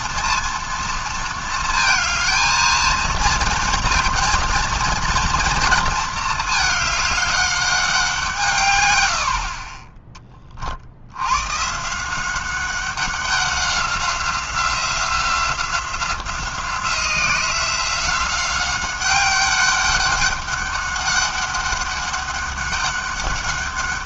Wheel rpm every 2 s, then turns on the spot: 230, 220, 230, 210, 130, 40, 190, 180, 180, 190, 200, 200.
none